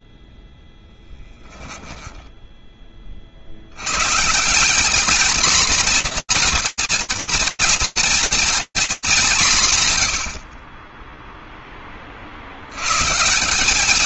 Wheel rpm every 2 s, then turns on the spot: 10, 70, 230, 230, 180, 10, 130.
0-2